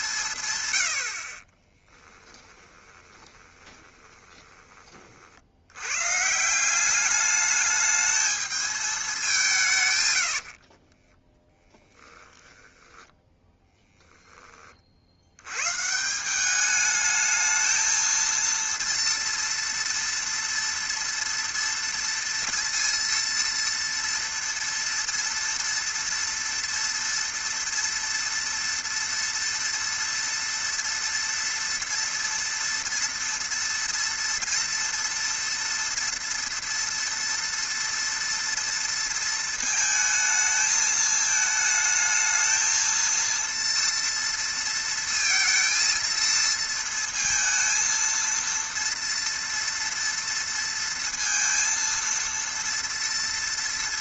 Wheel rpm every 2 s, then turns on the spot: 100, 20, 30, 180, 220, 50, 20, 40, 210, 230, 230, 230, 230, 230, 230, 230, 230, 230, 230, 230, 220, 230, 230, 230, 230, 230, 230.
2-4 10-14